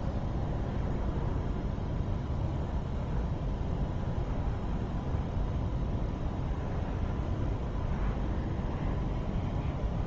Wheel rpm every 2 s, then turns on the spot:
0, 0, 0, 0, 0.
none